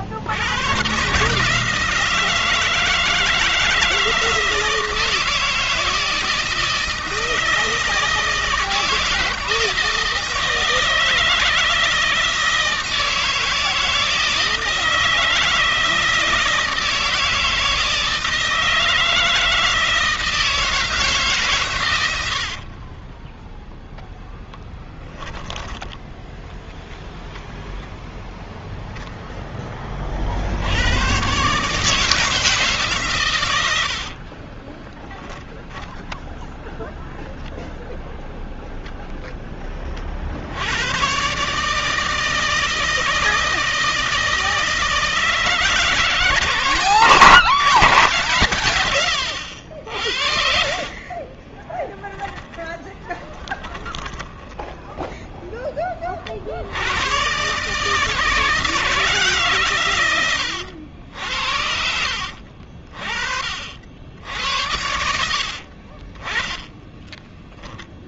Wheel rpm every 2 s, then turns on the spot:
120, 160, 160, 160, 160, 160, 160, 160, 160, 160, 160, 40, 10, 0, 0, 100, 140, 20, 0, 0, 110, 160, 160, 160, 100, 50, 20, 10, 100, 160, 80, 50, 80, 20.
22-24 34-36 50-54 66-68